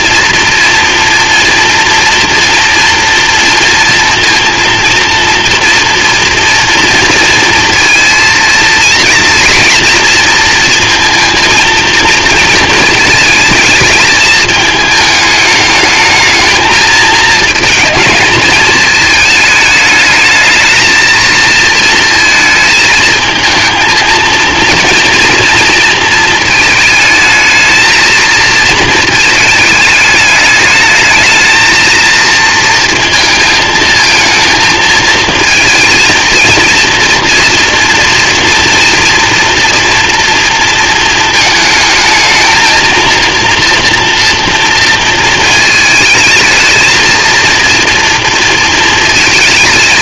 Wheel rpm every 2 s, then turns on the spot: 230, 240, 230, 230, 230, 230, 220, 220, 220, 220, 230, 220, 230, 220, 230, 210, 230, 220, 230, 230, 220, 230, 230, 220, 220.
none